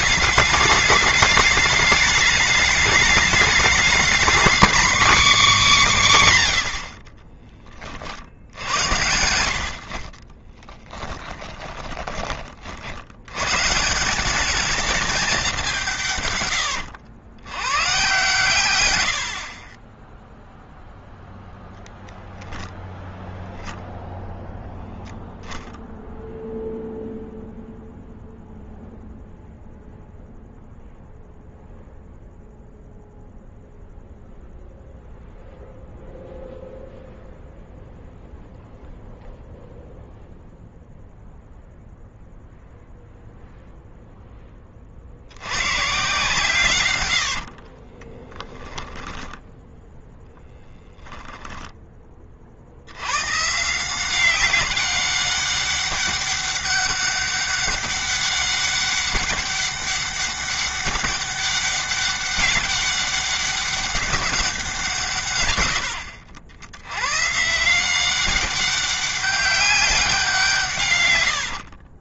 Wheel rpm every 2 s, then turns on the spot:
210, 210, 250, 60, 70, 10, 60, 210, 100, 90, 0, 0, 0, 0, 0, 0, 0, 0, 0, 0, 0, 0, 30, 100, 10, 0, 80, 200, 200, 190, 190, 200, 180, 110, 200, 150.
10-12 46-50 70-72